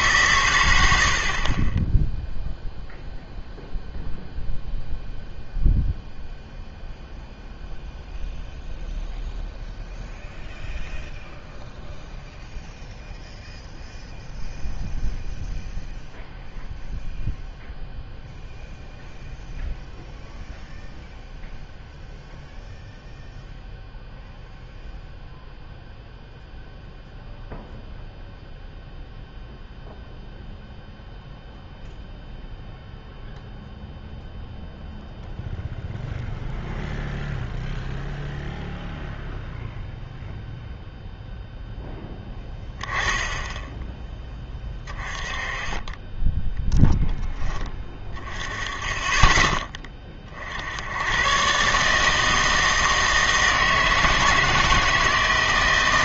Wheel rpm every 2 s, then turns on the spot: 110, 0, 0, 0, 0, 0, 0, 0, 0, 0, 0, 0, 0, 0, 0, 0, 0, 0, 0, 0, 0, 10, 20, 10, 20, 70, 160, 160.
none